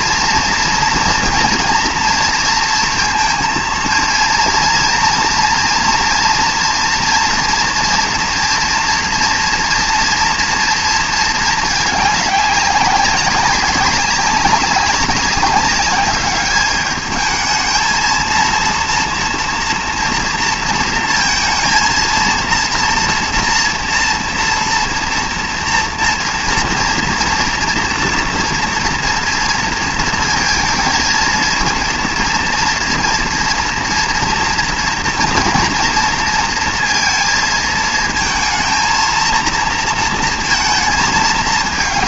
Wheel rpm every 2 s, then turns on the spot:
230, 230, 230, 240, 230, 230, 200, 190, 210, 230, 230, 230, 230, 230, 230, 230, 230, 230, 230, 230, 230.
none